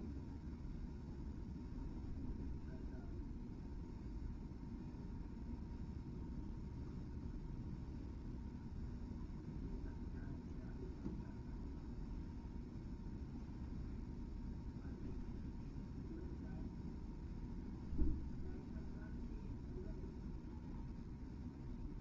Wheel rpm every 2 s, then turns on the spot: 0, 0, 0, 0, 0, 0, 0, 0, 0, 0, 0.
none